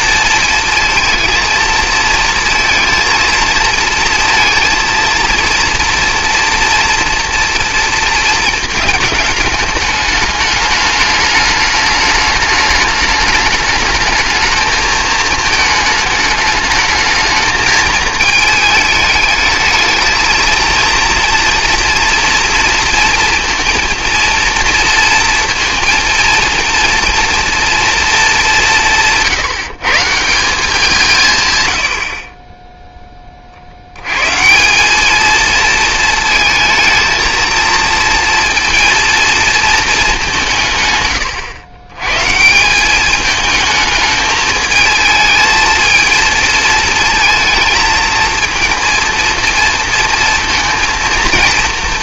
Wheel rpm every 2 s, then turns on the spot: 230, 230, 230, 230, 220, 210, 210, 220, 220, 220, 230, 230, 230, 230, 180, 170, 10, 180, 220, 230, 160, 170, 210, 220, 230, 230.
none